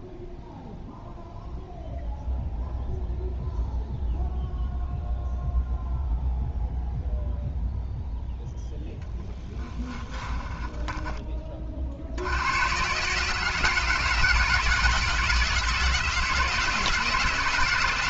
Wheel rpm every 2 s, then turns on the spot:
0, 0, 0, 0, 0, 20, 110, 160, 160.
10-12